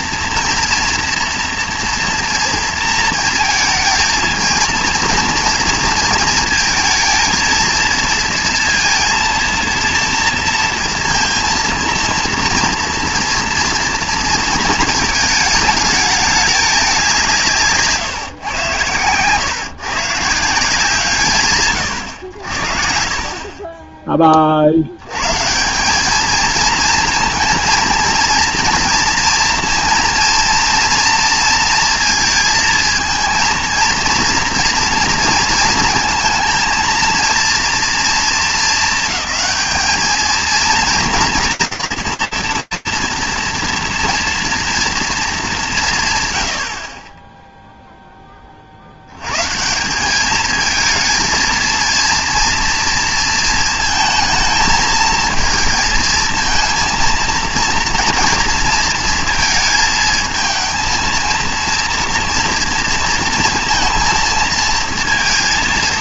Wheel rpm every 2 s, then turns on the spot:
240, 230, 220, 230, 230, 230, 230, 230, 210, 120, 160, 60, 50, 230, 230, 240, 220, 240, 230, 220, 230, 230, 230, 80, 50, 220, 230, 220, 230, 230, 220, 230, 230.
none